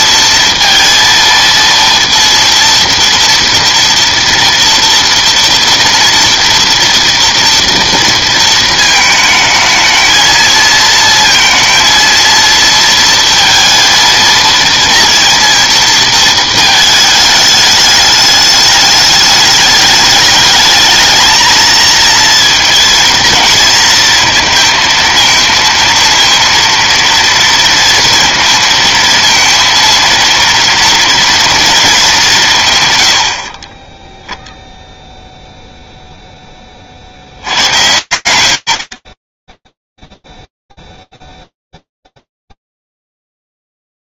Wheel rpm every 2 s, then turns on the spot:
230, 230, 230, 230, 220, 230, 230, 230, 220, 210, 220, 220, 230, 230, 230, 230, 110, 0, 60, 50, 0, 0.
none